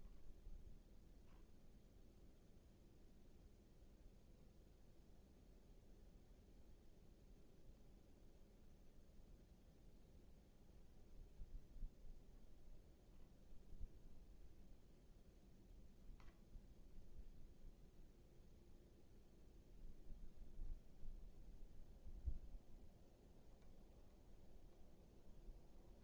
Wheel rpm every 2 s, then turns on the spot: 0, 0, 0, 0, 0, 0, 0, 0, 0, 0, 0, 0, 0.
none